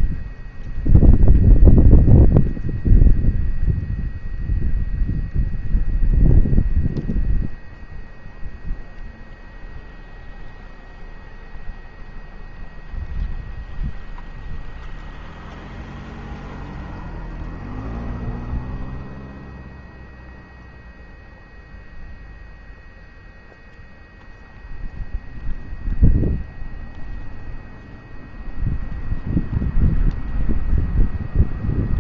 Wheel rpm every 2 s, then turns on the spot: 0, 0, 0, 0, 0, 0, 0, 0, 0, 0, 0, 0, 0, 0, 0, 0.
none